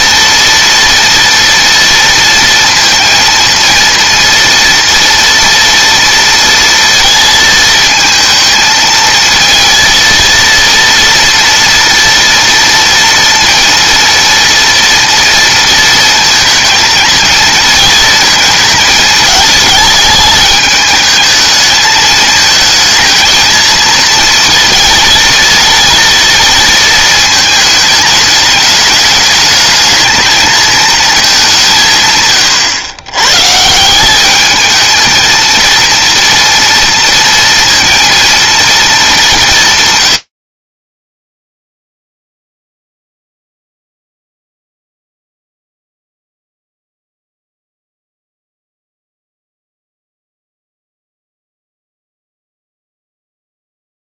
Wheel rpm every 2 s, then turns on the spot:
230, 230, 230, 230, 220, 230, 230, 230, 220, 220, 210, 220, 230, 230, 210, 220, 130, 200, 230, 230, 80, 0, 0, 0, 0, 0, 0.
none